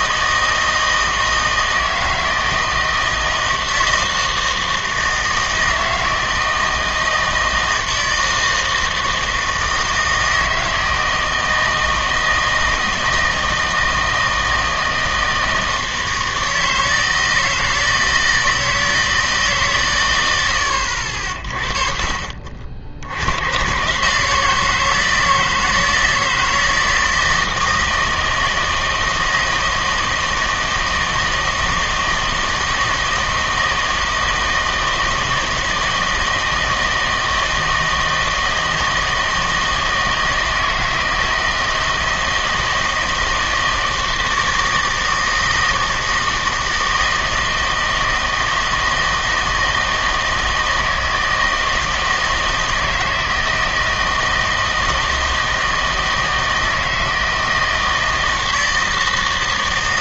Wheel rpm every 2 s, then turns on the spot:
160, 160, 160, 160, 160, 160, 160, 160, 160, 160, 80, 70, 160, 160, 160, 160, 160, 160, 160, 160, 160, 160, 160, 160, 160, 160, 160, 160, 160, 160.
none